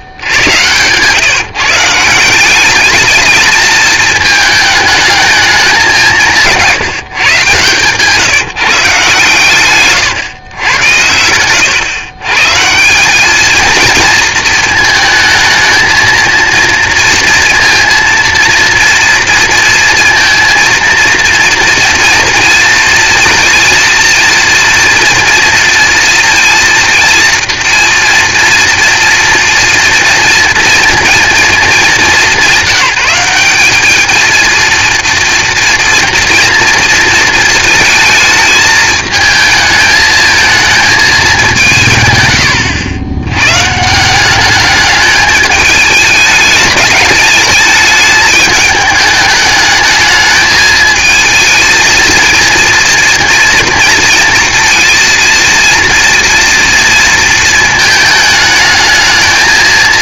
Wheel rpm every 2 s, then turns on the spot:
110, 200, 220, 170, 150, 110, 160, 220, 230, 230, 230, 230, 230, 230, 230, 230, 200, 230, 230, 220, 220, 110, 200, 210, 210, 220, 230, 230, 230, 220.
none